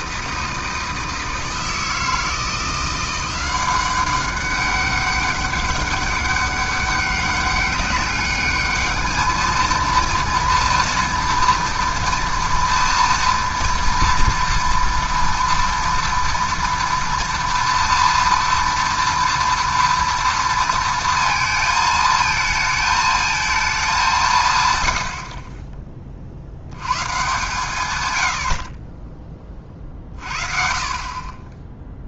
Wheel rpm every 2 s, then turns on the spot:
160, 170, 200, 200, 210, 230, 230, 230, 230, 230, 230, 220, 120, 90, 40, 40.
none